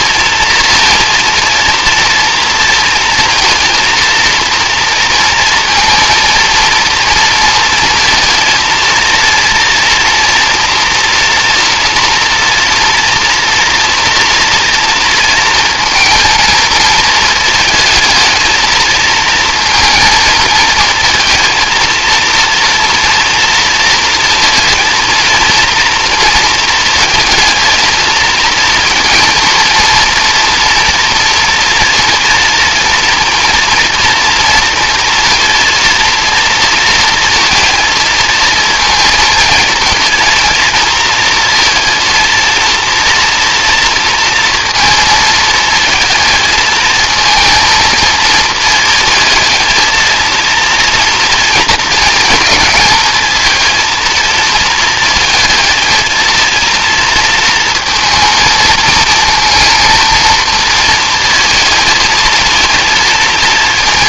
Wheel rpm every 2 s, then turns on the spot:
230, 230, 230, 230, 230, 230, 230, 230, 220, 220, 230, 230, 230, 230, 230, 230, 230, 230, 230, 220, 230, 230, 230, 220, 220, 230, 220, 220, 230, 230, 230, 230.
none